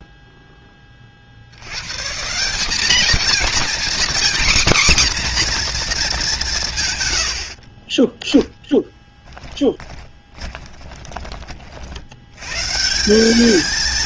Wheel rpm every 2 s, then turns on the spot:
20, 200, 260, 150, 10, 20, 150.
8-12